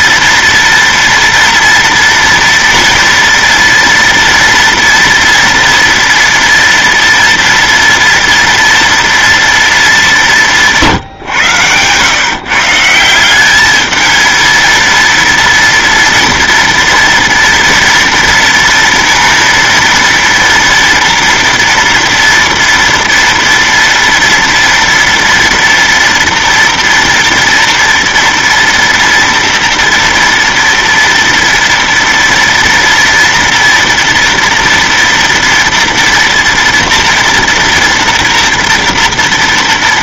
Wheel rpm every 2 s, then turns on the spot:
230, 230, 230, 230, 240, 190, 150, 230, 230, 230, 230, 230, 230, 230, 230, 230, 230, 230, 230, 230.
none